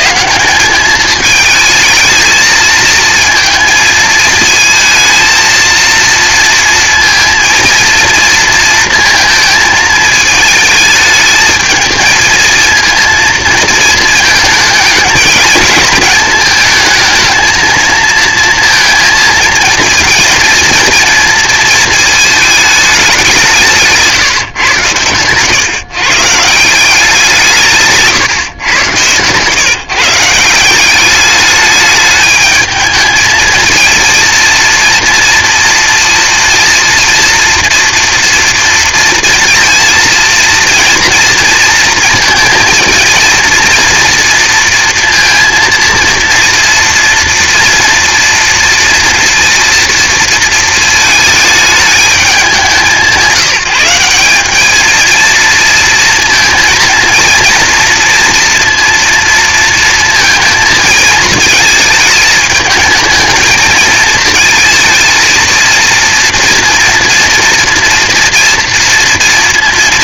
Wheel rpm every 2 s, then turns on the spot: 210, 220, 230, 230, 230, 220, 230, 220, 220, 230, 230, 200, 120, 180, 120, 190, 220, 230, 230, 230, 230, 230, 230, 230, 230, 220, 180, 220, 230, 230, 220, 220, 220, 230, 230.
none